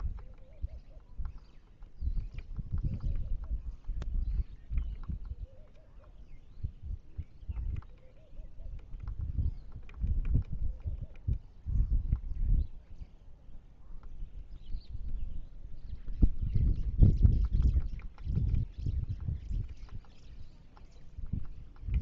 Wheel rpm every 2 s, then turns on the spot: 0, 0, 0, 0, 0, 0, 0, 0, 0, 0, 0.
none